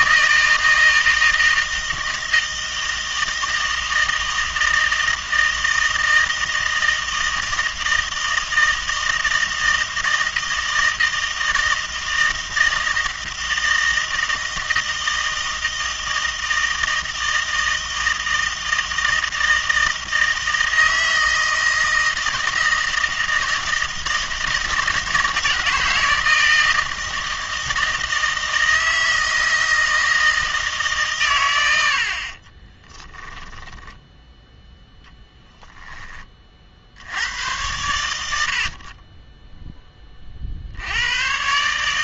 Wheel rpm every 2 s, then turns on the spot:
160, 160, 160, 160, 160, 160, 160, 160, 160, 160, 160, 160, 160, 160, 160, 160, 20, 10, 50, 60, 70.
32-36